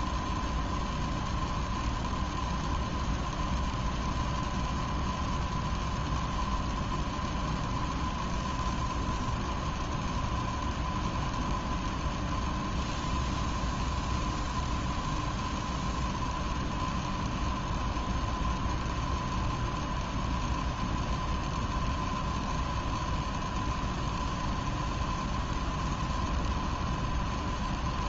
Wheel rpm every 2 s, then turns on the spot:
0, 0, 0, 0, 0, 0, 0, 0, 0, 0, 0, 0, 0, 0.
none